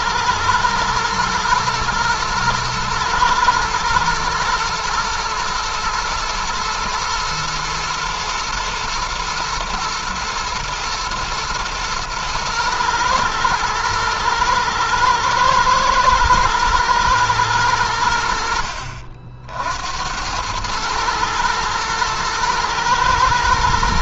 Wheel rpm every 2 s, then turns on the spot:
110, 110, 110, 110, 120, 110, 110, 110, 110, 60, 110, 110.
none